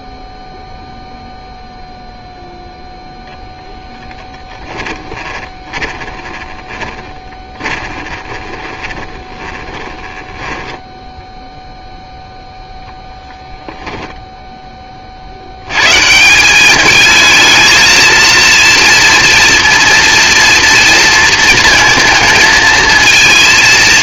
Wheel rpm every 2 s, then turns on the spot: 0, 0, 10, 20, 20, 10, 0, 40, 220, 230, 230, 230.
6-12